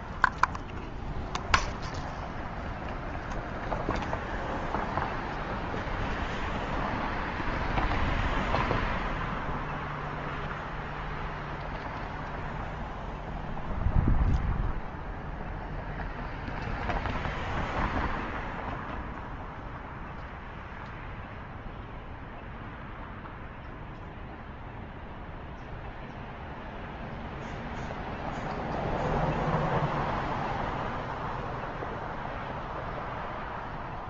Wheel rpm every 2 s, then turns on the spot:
0, 0, 0, 0, 0, 0, 0, 0, 0, 0, 0, 0, 0, 0, 0, 0, 0.
none